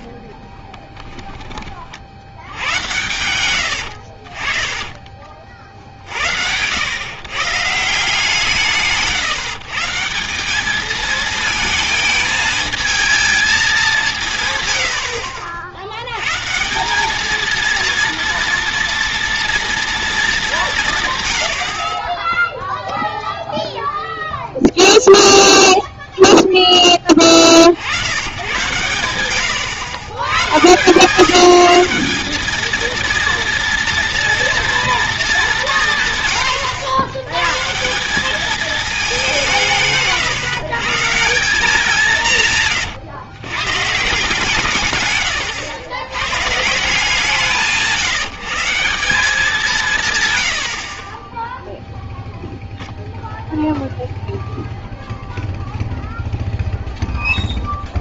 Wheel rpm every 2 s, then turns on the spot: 10, 90, 30, 110, 160, 200, 220, 90, 170, 230, 170, 0, 0, 10, 100, 130, 220, 230, 110, 210, 140, 120, 140, 160, 180, 70, 0, 0, 0.
4-6